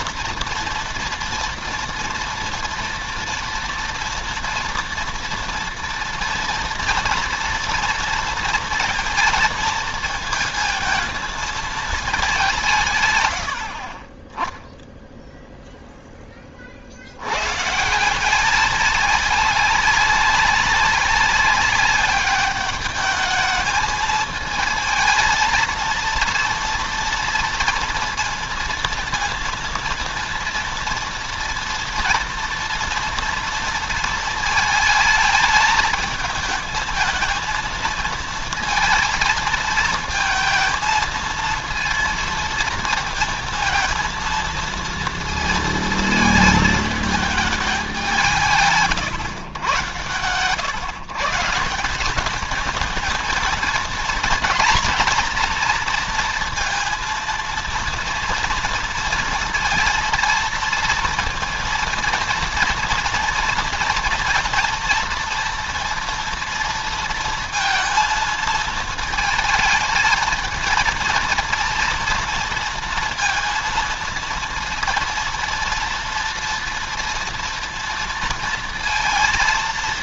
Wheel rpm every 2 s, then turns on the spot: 230, 230, 230, 230, 230, 230, 160, 10, 30, 200, 200, 200, 220, 230, 230, 230, 230, 220, 220, 230, 230, 230, 230, 220, 150, 130, 210, 230, 230, 230, 230, 230, 230, 230, 220, 230, 230, 230, 240, 230.
none